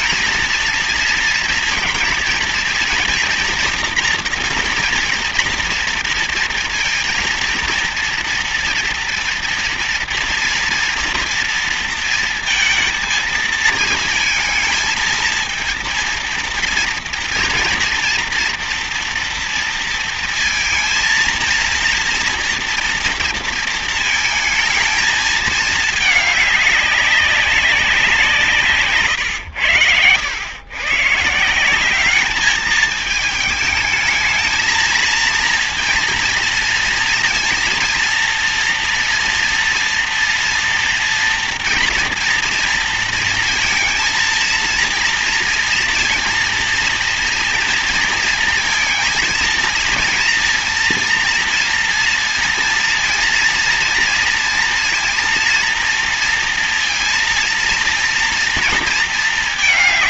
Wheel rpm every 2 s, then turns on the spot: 230, 240, 230, 230, 230, 230, 220, 220, 230, 230, 230, 230, 220, 200, 140, 130, 210, 220, 230, 230, 230, 230, 230, 230, 230, 230, 230, 230, 230, 230.
none